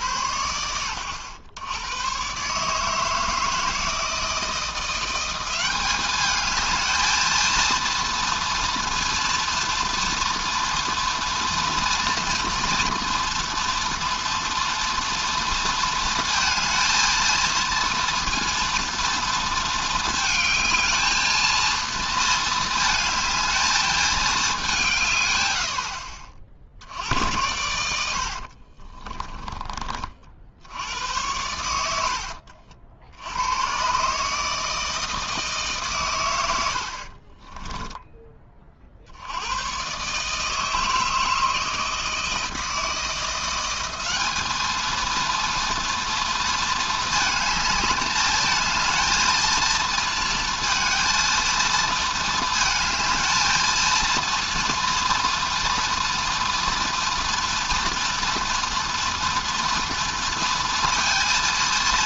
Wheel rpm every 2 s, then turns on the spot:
60, 140, 170, 210, 230, 230, 230, 230, 230, 230, 220, 220, 190, 60, 50, 80, 70, 160, 60, 70, 160, 160, 230, 220, 230, 230, 220, 240, 240, 230, 230.
28-30 36-38